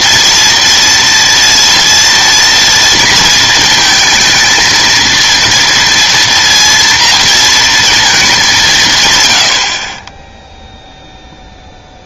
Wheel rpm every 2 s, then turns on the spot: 230, 230, 230, 230, 190, 0.
none